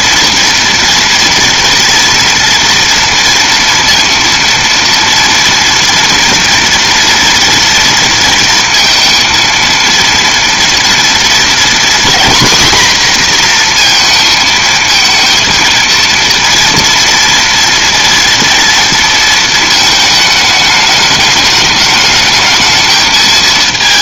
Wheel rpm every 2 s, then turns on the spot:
230, 230, 230, 230, 230, 230, 240, 220, 230, 230, 210, 220.
none